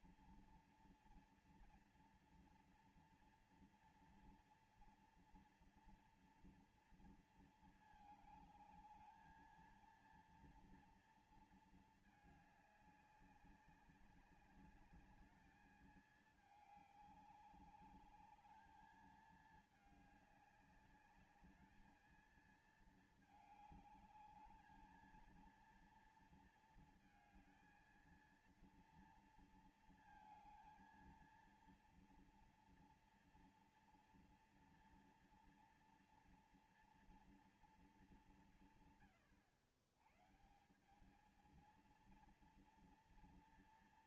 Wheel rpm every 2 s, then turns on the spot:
240, 230, 230, 230, 220, 230, 220, 190, 210, 210, 210, 220, 210, 230, 230, 230, 230, 230, 230, 200, 140, 230.
none